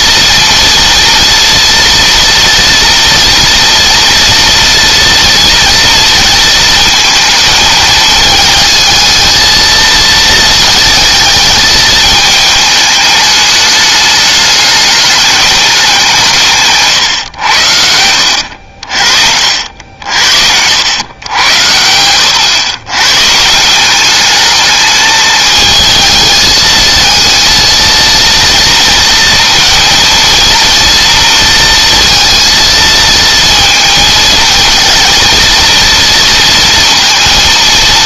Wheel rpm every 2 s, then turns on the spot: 230, 230, 230, 220, 220, 220, 220, 210, 150, 70, 80, 100, 210, 220, 230, 230, 230, 220, 230.
none